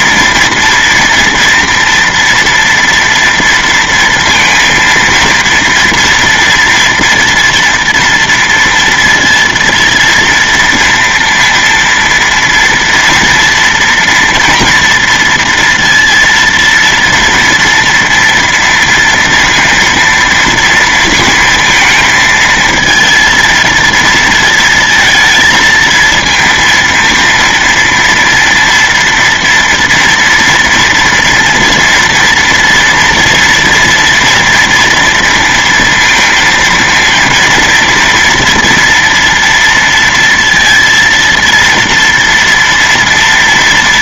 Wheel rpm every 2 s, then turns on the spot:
230, 230, 230, 240, 230, 230, 230, 230, 230, 230, 230, 220, 230, 230, 230, 230, 230, 230, 230, 230, 230, 230.
none